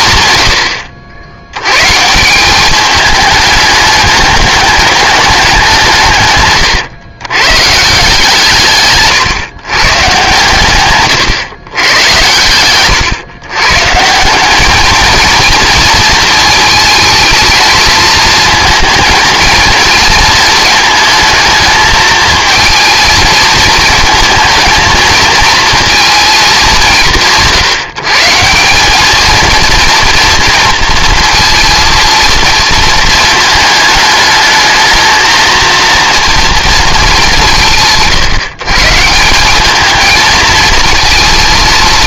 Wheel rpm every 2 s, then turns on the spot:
100, 190, 210, 120, 160, 140, 110, 200, 220, 230, 230, 220, 220, 200, 180, 230, 220, 220, 230, 150, 220.
12-14